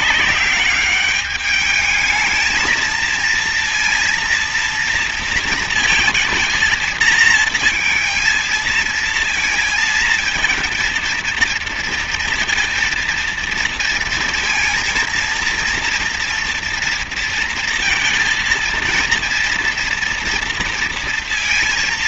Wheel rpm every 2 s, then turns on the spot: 200, 220, 230, 230, 230, 230, 230, 230, 230, 230, 230.
none